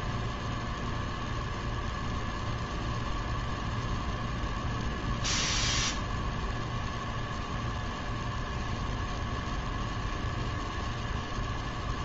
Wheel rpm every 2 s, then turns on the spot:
0, 0, 0, 0, 0, 0.
none